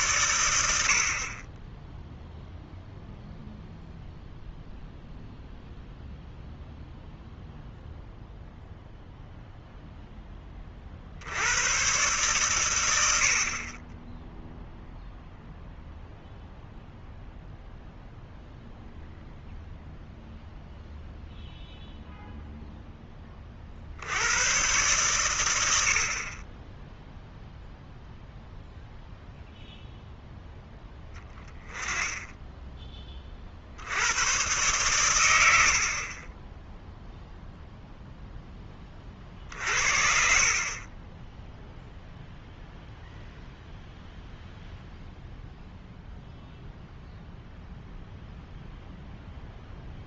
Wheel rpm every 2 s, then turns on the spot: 70, 0, 0, 0, 0, 40, 100, 0, 0, 0, 0, 10, 110, 10, 0, 10, 20, 100, 0, 30, 10, 0, 0, 0, 0.
none